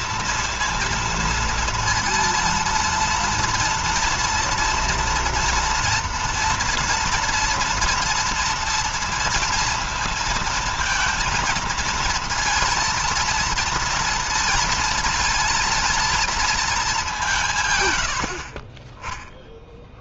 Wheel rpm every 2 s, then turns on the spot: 230, 230, 230, 230, 230, 230, 230, 230, 220, 60.
none